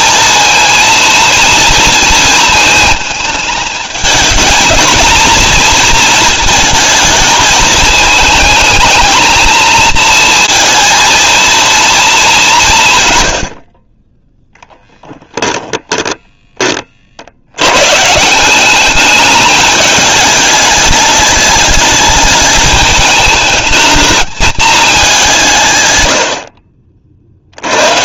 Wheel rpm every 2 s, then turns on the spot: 230, 220, 220, 230, 220, 230, 180, 0, 30, 200, 210, 220, 220, 50.
none